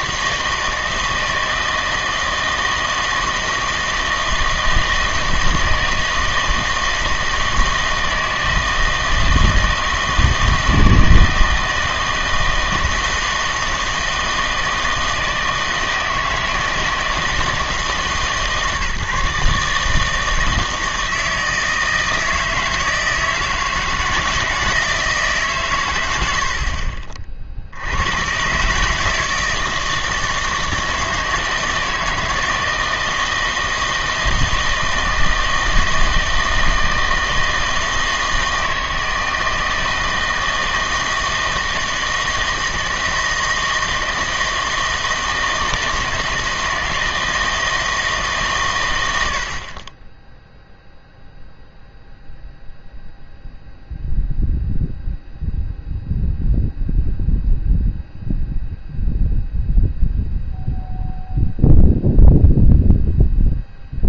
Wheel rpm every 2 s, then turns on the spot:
160, 160, 160, 160, 160, 160, 160, 160, 160, 150, 160, 160, 160, 60, 140, 160, 160, 160, 160, 160, 160, 160, 160, 160, 120, 0, 0, 0, 0, 0, 0, 0.
none